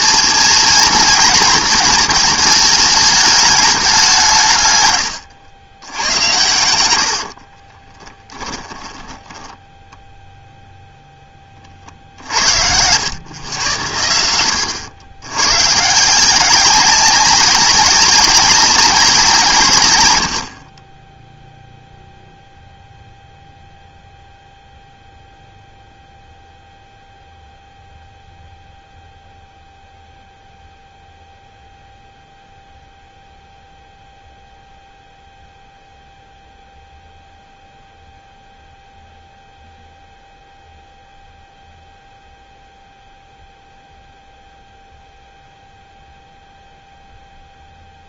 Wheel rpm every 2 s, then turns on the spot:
230, 210, 130, 80, 10, 0, 80, 90, 180, 190, 40, 0, 0, 0, 0, 0, 0, 0, 0, 0, 0, 0, 0, 0.
6-10